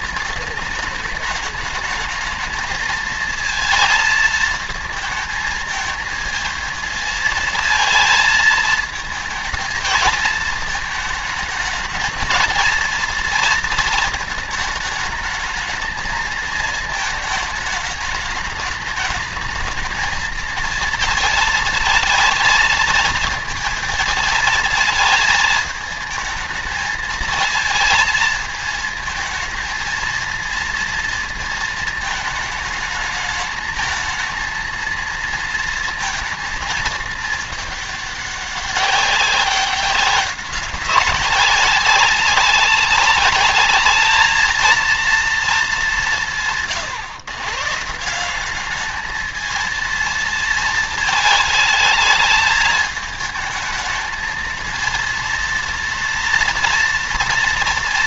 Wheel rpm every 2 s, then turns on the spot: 210, 220, 220, 220, 220, 220, 230, 220, 220, 210, 220, 220, 220, 220, 220, 230, 220, 220, 220, 200, 200, 190, 220, 150, 210, 220, 220, 230, 230.
none